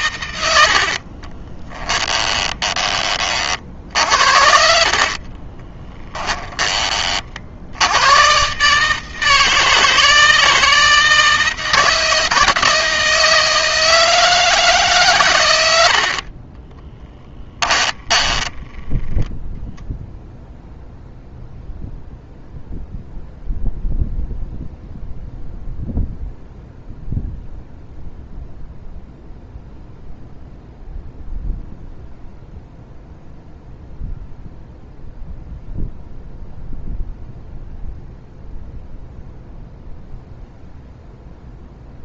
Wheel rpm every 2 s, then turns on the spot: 70, 20, 50, 20, 130, 160, 160, 150, 40, 20, 0, 0, 0, 0, 0, 0, 0, 0, 0, 0, 0.
0-6 16-20